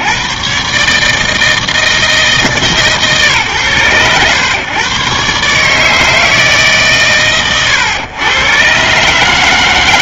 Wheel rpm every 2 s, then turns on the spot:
50, 160, 120, 160, 110.
none